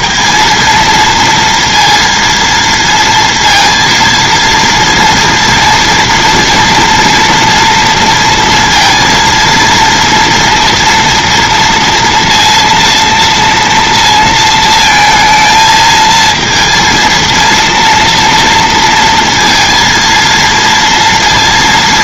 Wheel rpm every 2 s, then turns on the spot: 230, 230, 230, 240, 230, 230, 230, 230, 230, 230, 230.
none